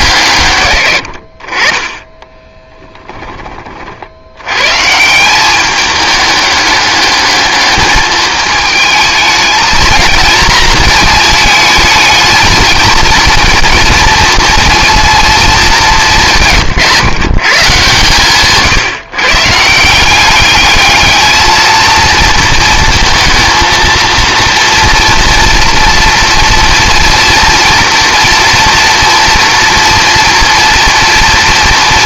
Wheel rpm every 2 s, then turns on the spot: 110, 10, 150, 200, 210, 230, 220, 230, 140, 150, 210, 230, 230, 230, 230, 230.
2-4